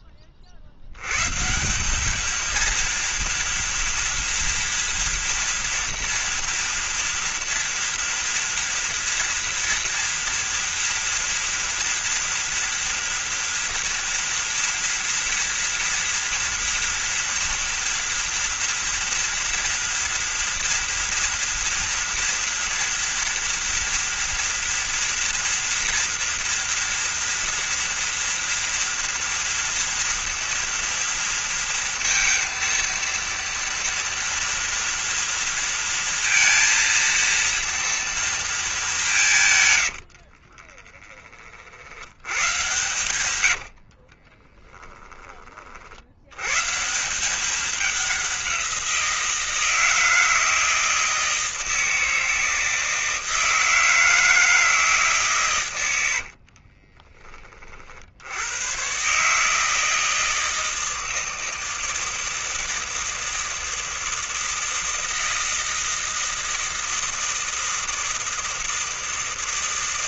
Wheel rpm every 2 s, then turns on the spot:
80, 230, 230, 230, 230, 230, 230, 230, 230, 230, 230, 230, 230, 230, 230, 230, 230, 240, 230, 200, 30, 120, 20, 150, 180, 160, 160, 160, 30, 120, 160, 160, 160, 160, 160.
40-44 56-58